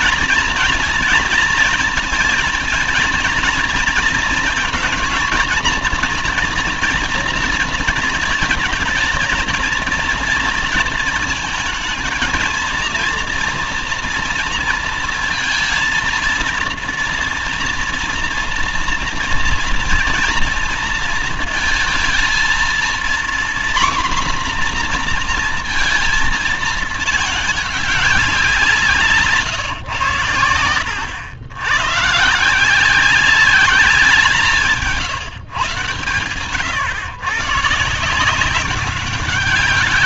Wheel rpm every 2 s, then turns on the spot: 230, 230, 230, 240, 220, 220, 230, 230, 230, 240, 230, 240, 240, 210, 180, 110, 190, 160, 120, 190.
none